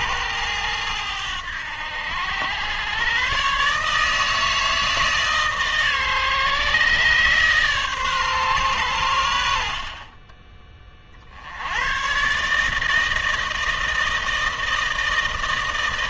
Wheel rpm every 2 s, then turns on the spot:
100, 110, 160, 140, 120, 30, 160, 160.
none